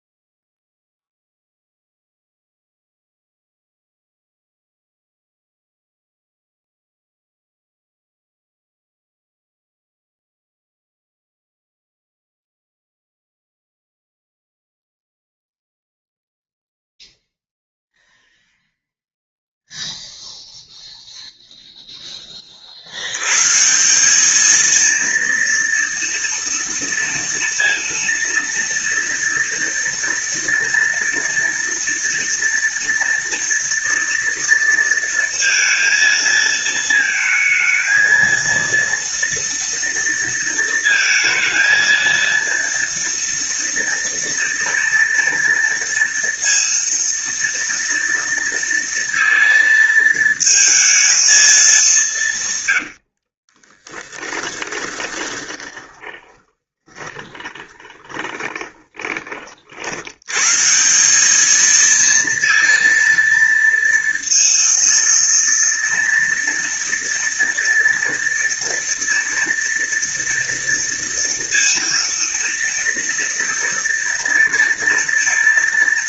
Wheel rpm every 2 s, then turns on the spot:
0, 0, 0, 0, 0, 0, 0, 0, 0, 0, 0, 60, 230, 230, 230, 240, 230, 230, 220, 230, 230, 230, 230, 230, 230, 220, 100, 20, 10, 20, 170, 230, 230, 230, 230, 230, 230, 230.
52-60